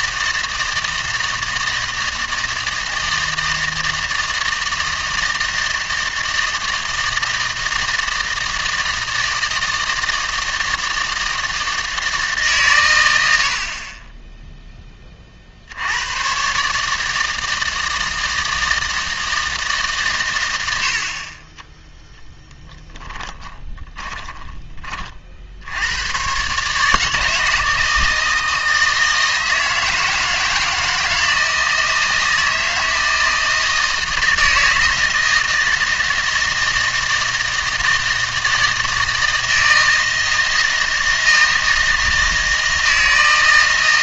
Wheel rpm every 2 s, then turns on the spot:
160, 160, 160, 160, 160, 160, 140, 10, 140, 160, 80, 10, 20, 140, 160, 160, 160, 160, 160, 160, 160, 160.
none